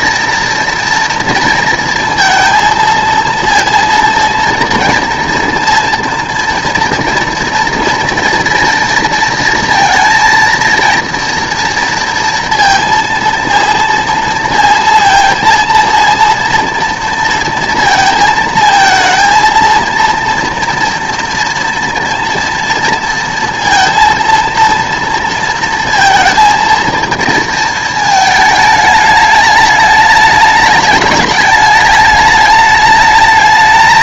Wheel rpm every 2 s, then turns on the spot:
240, 230, 230, 230, 230, 230, 230, 230, 230, 220, 230, 230, 230, 230, 210, 210, 210.
none